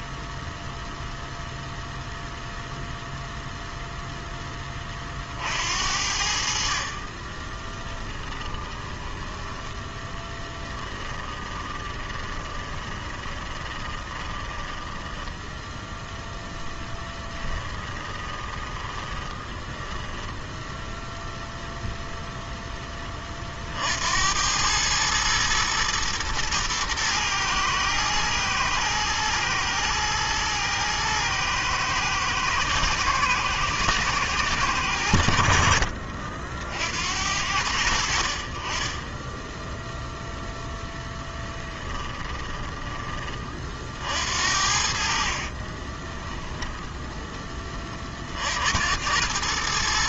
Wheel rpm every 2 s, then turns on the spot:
0, 0, 40, 30, 10, 10, 20, 10, 10, 10, 0, 20, 110, 110, 110, 110, 110, 90, 70, 20, 0, 20, 50, 10, 90.
8-20 44-46